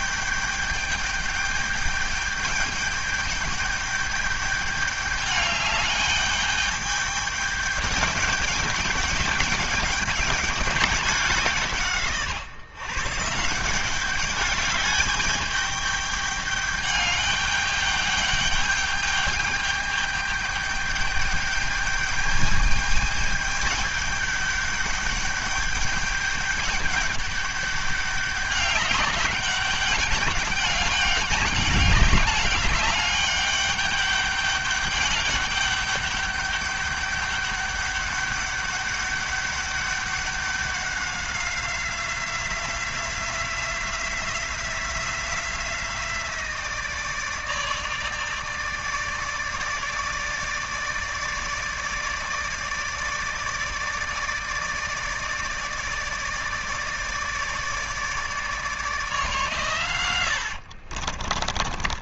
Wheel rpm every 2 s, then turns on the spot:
210, 210, 210, 210, 210, 200, 140, 200, 210, 210, 210, 210, 200, 200, 200, 200, 200, 200, 200, 200, 200, 180, 180, 170, 150, 160, 160, 150, 150, 150, 70.
60-62